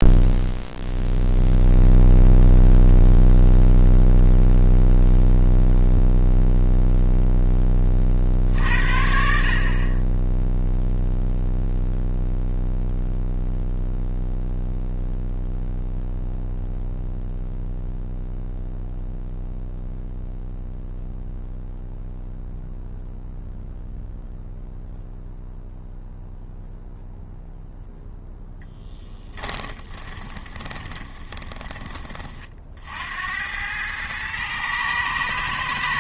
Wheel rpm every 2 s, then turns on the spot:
0, 0, 0, 0, 70, 0, 0, 0, 0, 0, 0, 0, 0, 0, 10, 20, 50, 110.
28-32